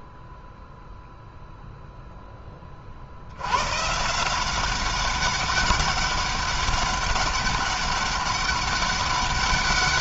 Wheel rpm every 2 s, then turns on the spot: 0, 40, 190, 200, 200.
none